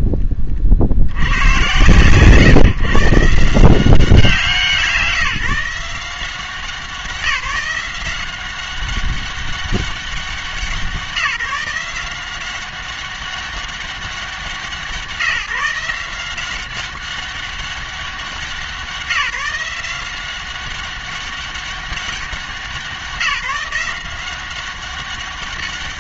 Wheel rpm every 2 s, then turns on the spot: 30, 140, 170, 180, 190, 190, 190, 180, 190, 180, 190, 190, 190.
none